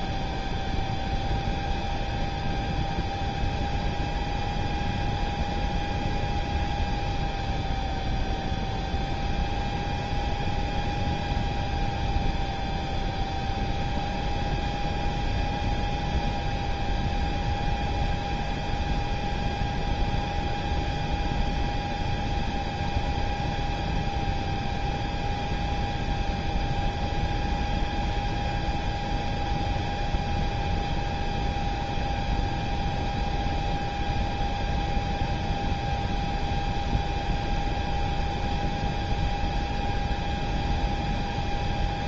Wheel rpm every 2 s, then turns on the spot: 0, 0, 0, 0, 0, 0, 0, 0, 0, 0, 0, 0, 0, 0, 0, 0, 0, 0, 0, 0, 0.
none